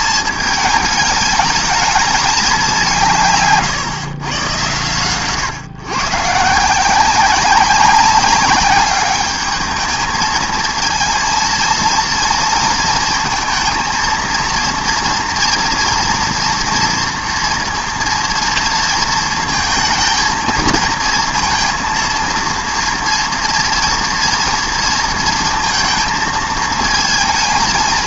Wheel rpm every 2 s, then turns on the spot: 220, 200, 120, 160, 200, 220, 230, 230, 230, 230, 230, 230, 230, 220.
none